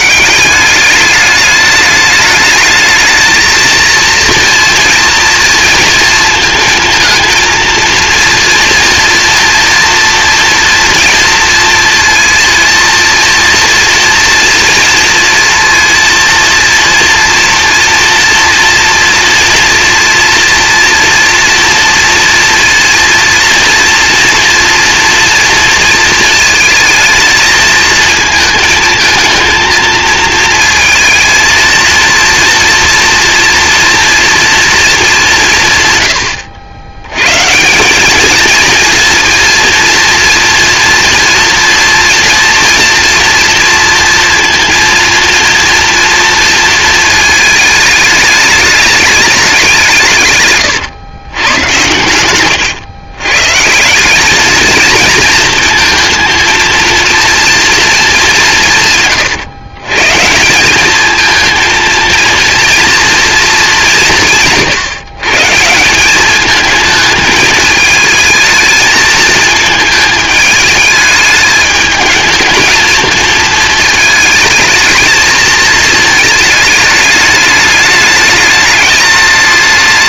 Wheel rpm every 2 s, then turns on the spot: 200, 220, 230, 230, 230, 230, 230, 230, 230, 230, 230, 230, 230, 220, 220, 230, 230, 220, 80, 230, 230, 230, 230, 230, 210, 120, 120, 220, 230, 170, 180, 230, 160, 220, 220, 220, 220, 220, 210, 210.
none